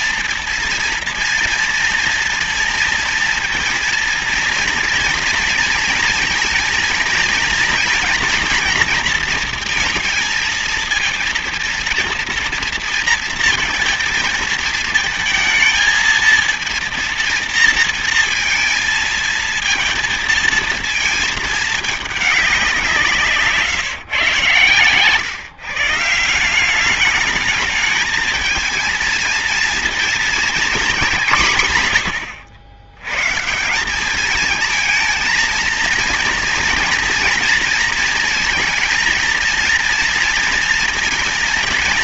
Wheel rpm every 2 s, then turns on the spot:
230, 230, 230, 230, 240, 230, 230, 230, 230, 230, 220, 200, 130, 170, 220, 230, 110, 210, 230, 230, 230.
none